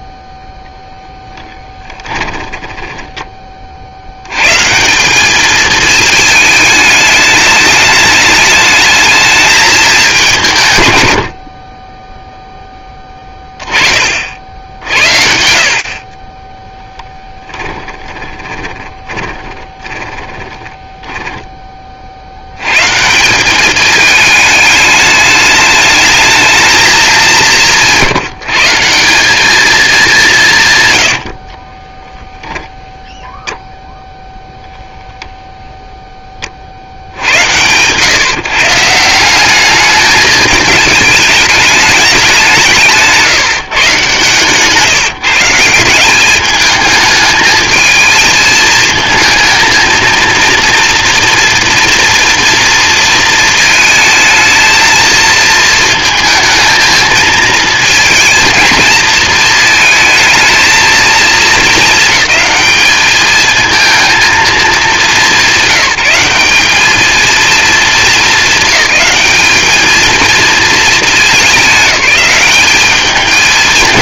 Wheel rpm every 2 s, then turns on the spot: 10, 30, 210, 210, 220, 60, 10, 50, 10, 20, 20, 200, 210, 180, 200, 40, 0, 0, 70, 180, 210, 160, 150, 210, 220, 230, 230, 220, 220, 220, 220, 220, 180, 220, 210, 210, 210.
0-2 10-12 16-20 30-32